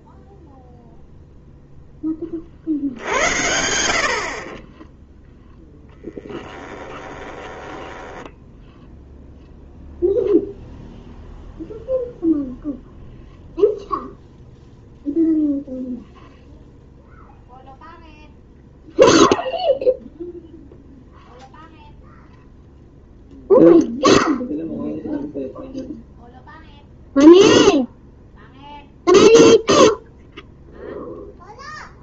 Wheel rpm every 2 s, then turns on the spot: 0, 40, 30, 10, 10, 0, 0, 0, 0, 0, 0, 0, 0, 0, 0, 0.
6-10